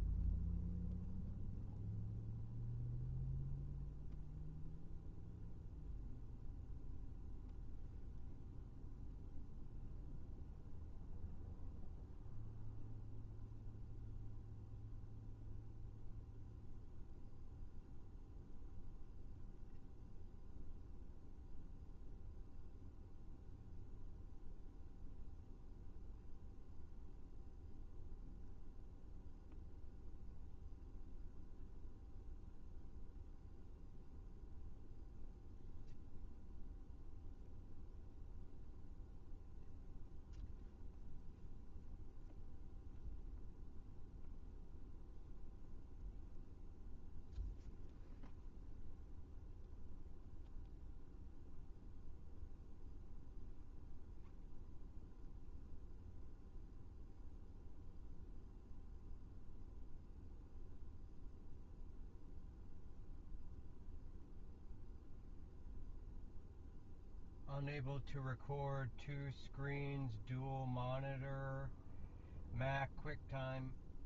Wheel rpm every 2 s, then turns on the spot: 0, 0, 0, 0, 0, 0, 0, 0, 0, 0, 0, 0, 0, 0, 0, 0, 0, 0, 0, 0, 0, 0, 0, 0, 0, 0, 0, 0, 0, 0, 0, 0, 0, 0, 0, 0, 0.
none